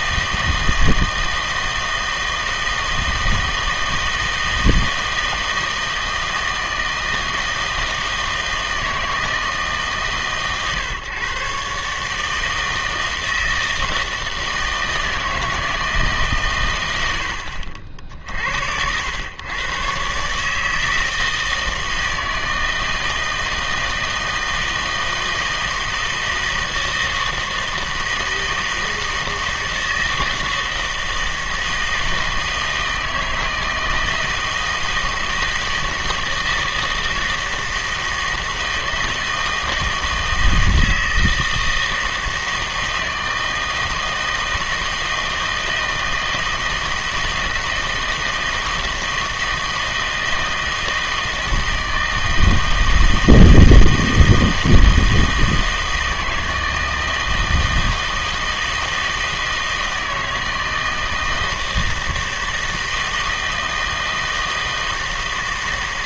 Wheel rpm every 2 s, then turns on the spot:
160, 160, 160, 160, 160, 130, 160, 160, 120, 80, 150, 160, 160, 160, 160, 160, 160, 160, 160, 160, 160, 160, 160, 160, 160, 160, 160, 160, 160, 160, 160, 160, 160.
none